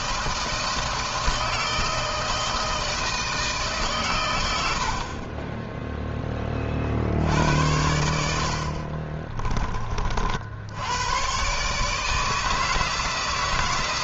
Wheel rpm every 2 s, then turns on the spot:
160, 160, 50, 60, 40, 110, 160.
8-10